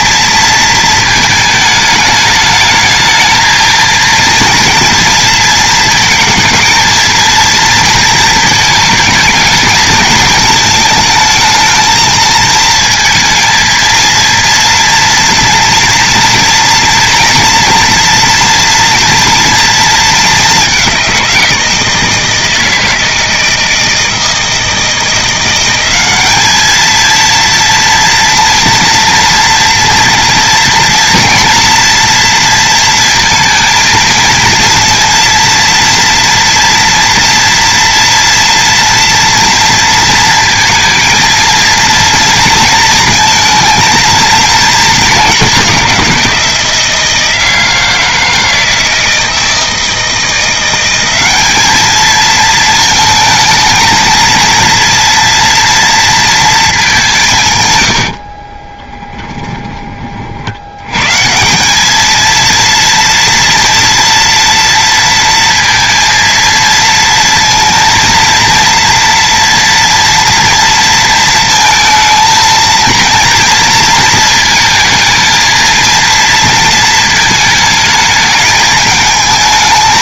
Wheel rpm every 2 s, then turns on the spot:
220, 210, 230, 230, 220, 220, 230, 230, 230, 230, 200, 160, 160, 220, 230, 230, 230, 230, 230, 240, 230, 230, 210, 160, 160, 180, 220, 230, 200, 20, 100, 230, 230, 230, 230, 230, 230, 220, 220, 220.
58-60